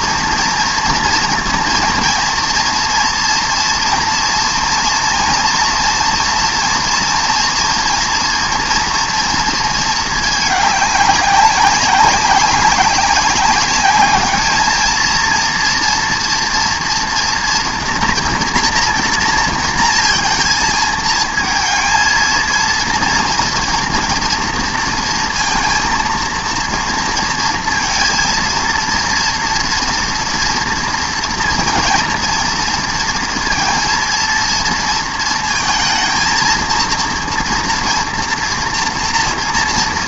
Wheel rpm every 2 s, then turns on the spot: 230, 240, 230, 230, 230, 210, 200, 220, 230, 240, 220, 230, 230, 230, 230, 230, 230, 230, 230, 230.
none